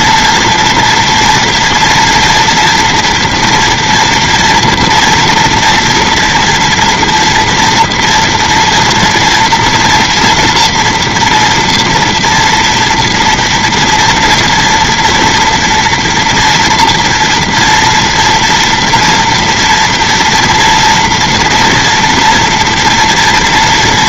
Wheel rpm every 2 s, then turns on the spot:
230, 230, 230, 230, 230, 240, 230, 230, 230, 230, 230, 230.
none